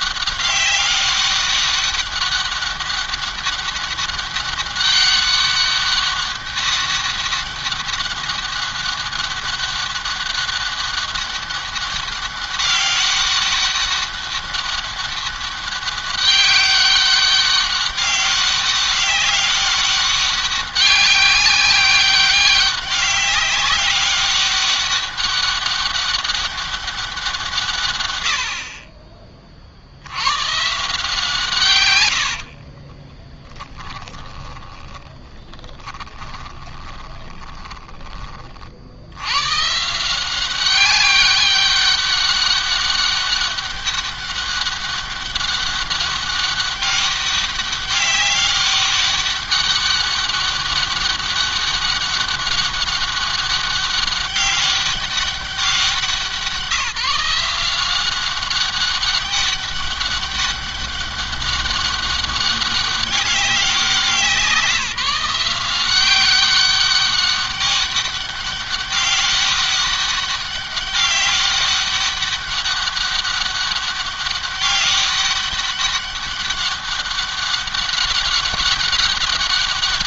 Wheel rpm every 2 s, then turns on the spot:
200, 200, 200, 200, 200, 200, 200, 190, 200, 200, 200, 200, 200, 200, 60, 120, 60, 10, 30, 50, 190, 200, 200, 200, 200, 200, 200, 200, 170, 190, 200, 200, 170, 190, 200, 200, 200, 200, 200, 200.
32-38